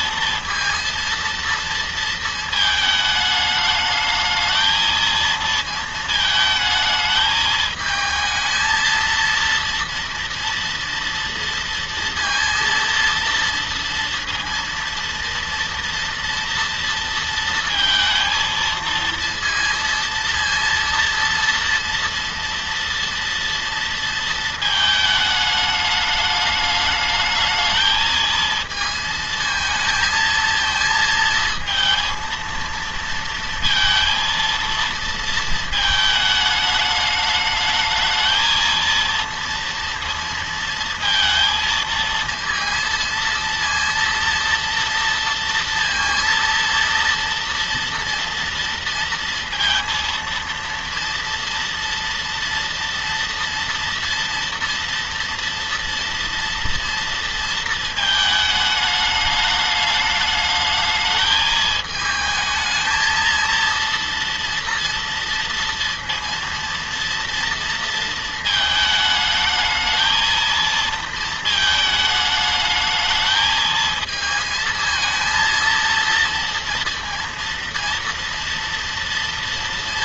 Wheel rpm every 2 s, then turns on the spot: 230, 220, 220, 220, 230, 230, 230, 230, 230, 230, 230, 230, 220, 210, 220, 220, 230, 230, 210, 230, 230, 230, 230, 230, 230, 230, 230, 230, 230, 210, 220, 220, 230, 230, 220, 230, 220, 230, 230, 230.
none